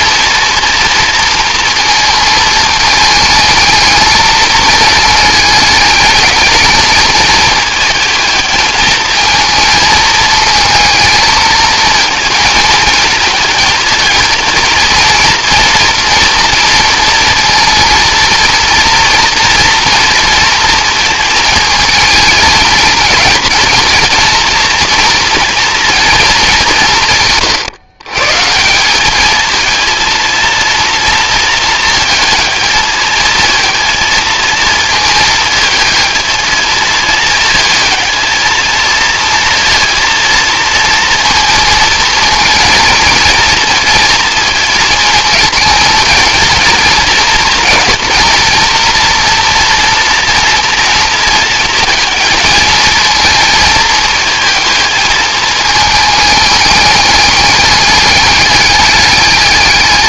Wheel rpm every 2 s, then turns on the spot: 230, 220, 220, 220, 220, 230, 220, 220, 230, 230, 230, 220, 230, 180, 180, 230, 220, 220, 220, 220, 230, 230, 230, 220, 230, 230, 220, 220, 210, 210.
none